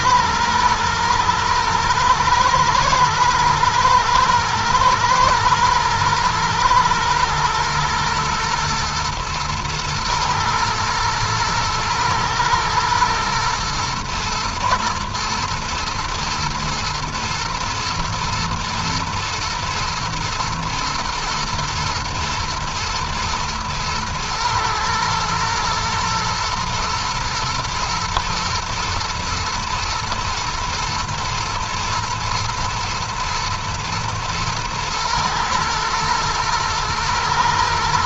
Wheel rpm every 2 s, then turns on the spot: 120, 120, 110, 110, 110, 110, 120, 110, 120, 110, 110, 110, 110, 120, 110, 120, 110, 120, 110.
none